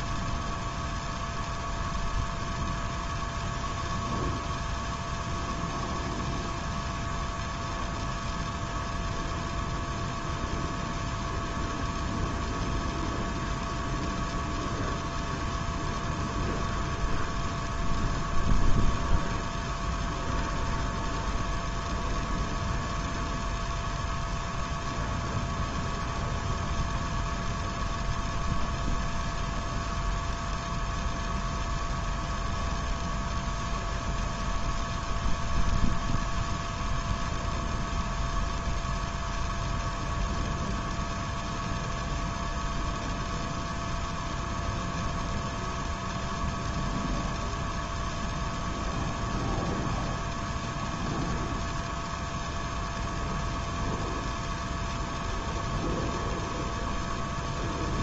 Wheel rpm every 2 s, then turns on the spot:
0, 0, 0, 0, 0, 0, 0, 0, 0, 0, 0, 0, 0, 0, 0, 0, 0, 0, 0, 0, 0, 0, 0, 0, 0, 0, 0, 0, 0.
none